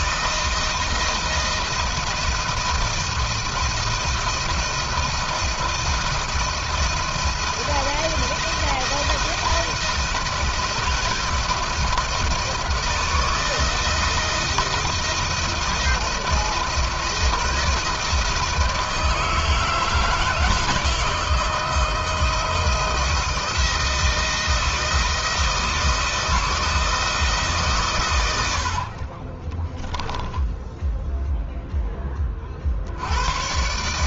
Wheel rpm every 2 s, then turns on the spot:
160, 160, 160, 160, 160, 160, 160, 160, 170, 160, 160, 170, 160, 160, 70, 0, 50.
none